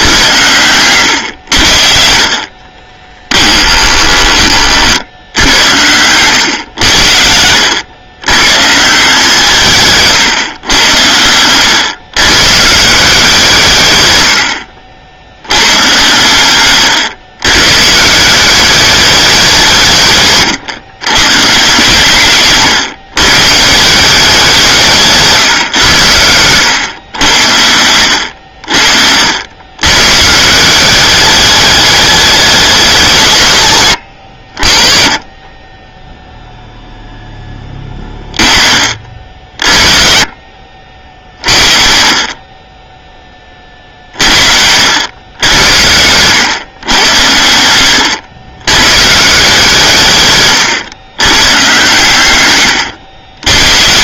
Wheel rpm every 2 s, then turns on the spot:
100, 30, 60, 90, 160, 110, 170, 70, 120, 200, 120, 130, 150, 100, 60, 200, 180, 30, 0, 40, 50, 20, 90, 110, 130, 100, 110.
2-4 16-18